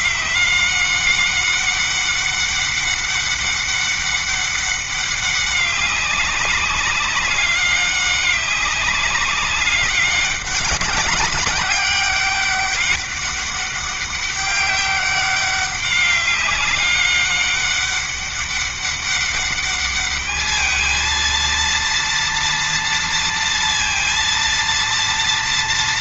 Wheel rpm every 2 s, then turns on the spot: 190, 200, 200, 200, 200, 200, 200, 200, 200, 200, 220, 230, 230.
none